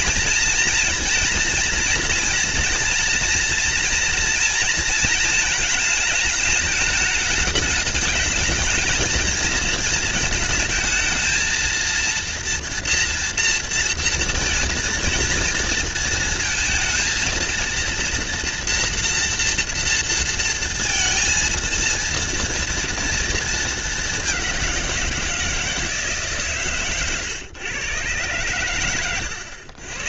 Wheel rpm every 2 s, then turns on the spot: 230, 230, 220, 210, 220, 220, 230, 230, 220, 230, 230, 230, 170, 130, 110.
28-30